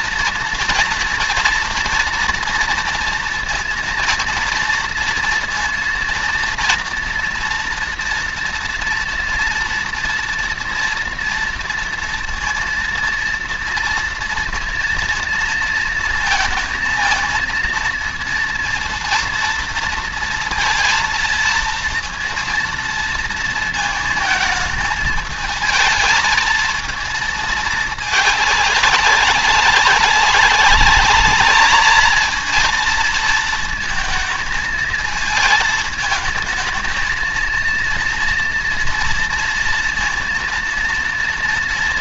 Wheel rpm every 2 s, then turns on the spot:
230, 230, 230, 230, 230, 230, 230, 230, 230, 230, 230, 230, 220, 220, 210, 200, 230, 220, 220, 230, 230.
none